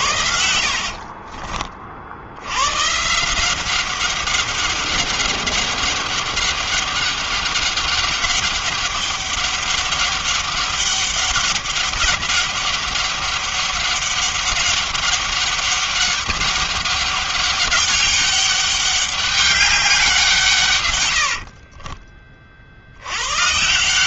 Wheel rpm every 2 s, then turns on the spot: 70, 70, 190, 200, 200, 200, 200, 200, 200, 200, 160, 40.
0-2